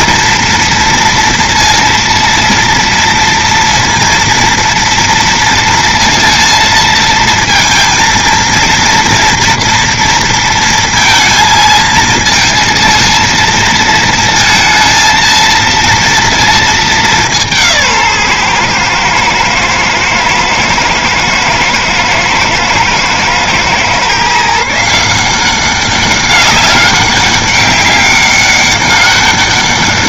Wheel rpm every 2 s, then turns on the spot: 230, 230, 230, 230, 230, 230, 230, 230, 220, 120, 110, 110, 150, 200, 200.
none